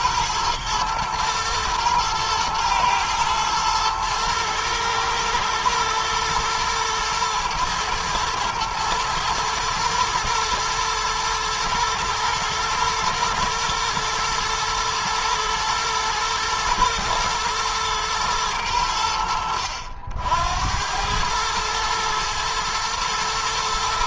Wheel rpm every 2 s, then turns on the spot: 110, 120, 120, 120, 110, 120, 110, 110, 110, 100, 80, 110.
none